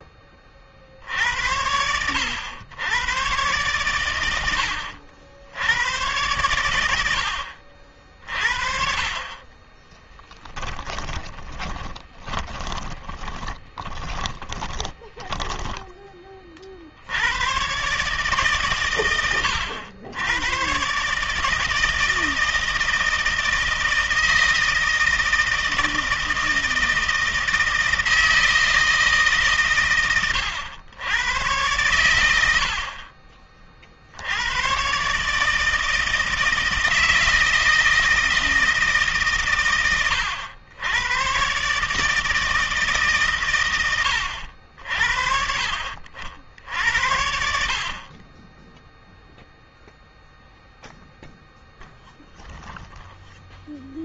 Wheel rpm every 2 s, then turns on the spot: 40, 110, 80, 100, 50, 20, 20, 20, 40, 130, 120, 160, 160, 160, 160, 100, 60, 120, 160, 160, 100, 160, 70, 70, 10, 0, 0.
10-16 48-50